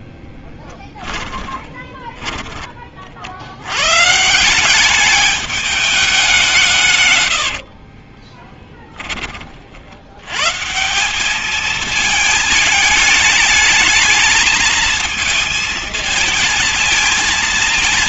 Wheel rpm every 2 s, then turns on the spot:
10, 40, 190, 150, 20, 160, 220, 220, 230.
0-2 8-10